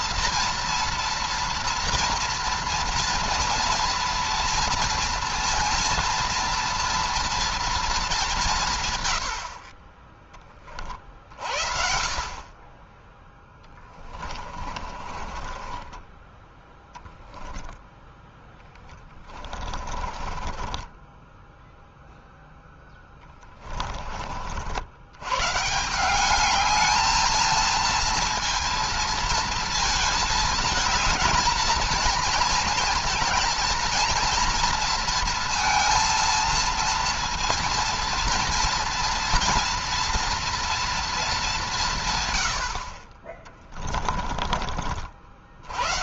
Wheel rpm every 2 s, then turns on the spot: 230, 230, 230, 230, 110, 40, 20, 30, 10, 20, 20, 10, 100, 220, 230, 220, 230, 230, 230, 230, 220, 50, 50.
14-16 18-24